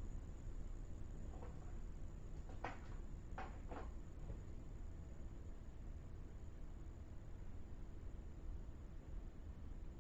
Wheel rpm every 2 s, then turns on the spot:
0, 0, 0, 0, 0.
none